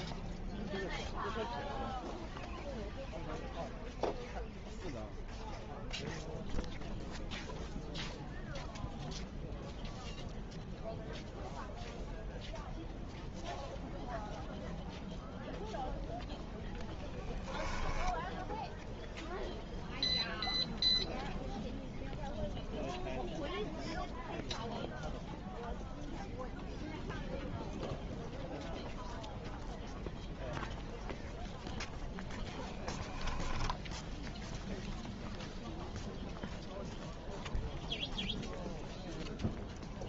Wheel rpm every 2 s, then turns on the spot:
0, 0, 0, 0, 0, 0, 0, 0, 0, 0, 0, 0, 0, 0, 0, 0, 0, 0, 0, 0.
none